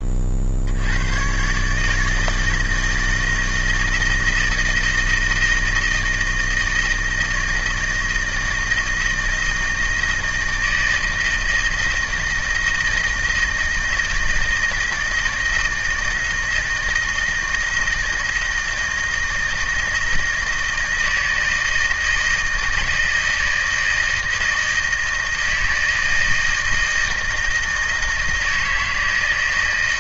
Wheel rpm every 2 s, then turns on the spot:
80, 160, 160, 160, 160, 160, 160, 160, 160, 160, 160, 160, 160, 160, 160.
none